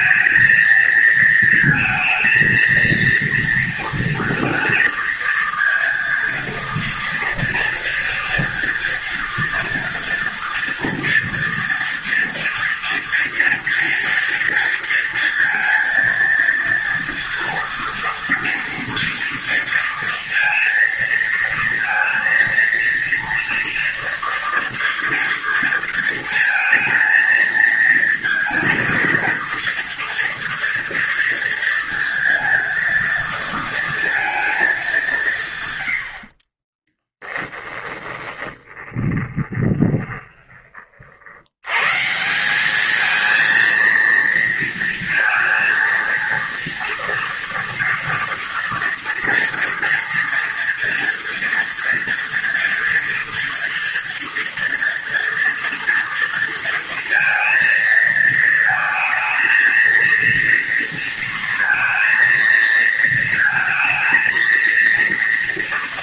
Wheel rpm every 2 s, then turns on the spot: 220, 230, 230, 230, 230, 230, 230, 230, 230, 230, 230, 230, 240, 230, 230, 230, 230, 220, 50, 20, 30, 190, 230, 230, 230, 230, 230, 230, 230, 220, 230, 230, 230.
36-40